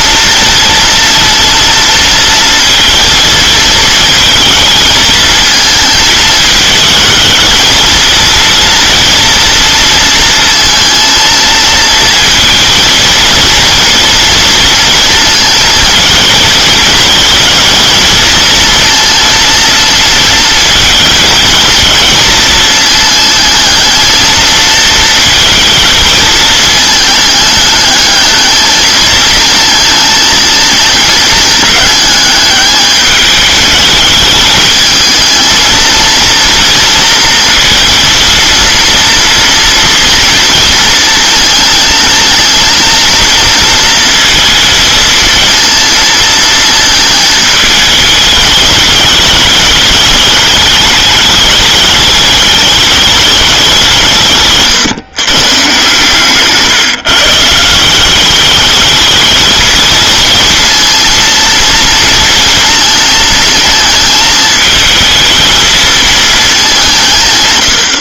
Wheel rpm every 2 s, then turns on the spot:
230, 230, 220, 220, 230, 230, 230, 230, 230, 230, 230, 220, 220, 210, 220, 220, 210, 220, 230, 230, 230, 230, 220, 220, 210, 210, 210, 130, 150, 210, 230, 230, 220, 200.
54-56